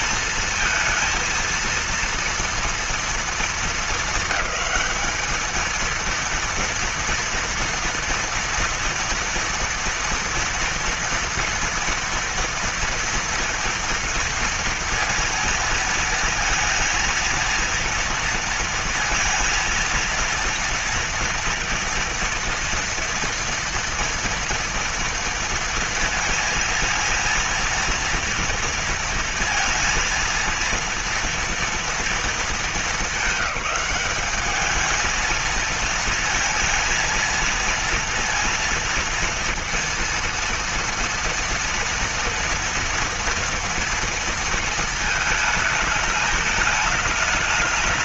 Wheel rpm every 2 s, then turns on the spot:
230, 230, 220, 230, 240, 230, 240, 230, 230, 230, 230, 230, 230, 230, 230, 230, 220, 210, 230, 230, 230, 230, 230, 210.
none